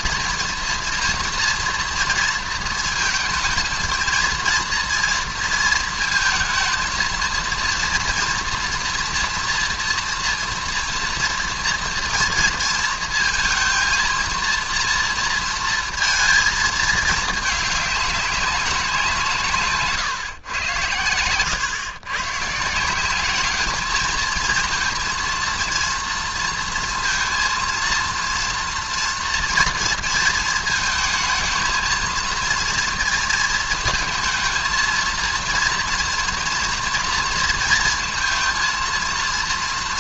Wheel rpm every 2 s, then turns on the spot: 230, 230, 240, 230, 230, 230, 230, 230, 220, 180, 110, 160, 230, 230, 230, 220, 230, 230, 230, 230.
none